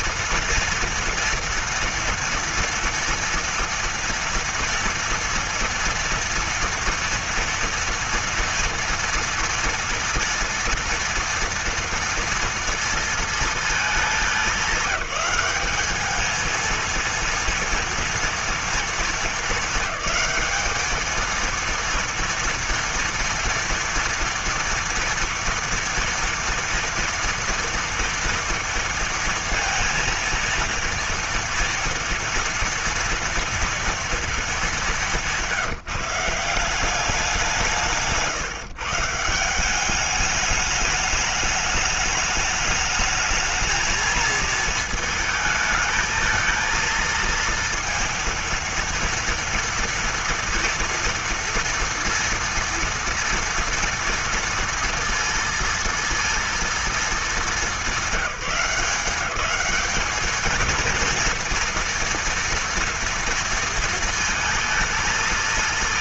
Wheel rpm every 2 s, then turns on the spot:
230, 230, 230, 230, 230, 230, 230, 200, 220, 230, 200, 230, 230, 230, 230, 230, 230, 210, 180, 140, 210, 210, 230, 230, 230, 230, 240, 230, 230, 190, 220, 230, 220.
none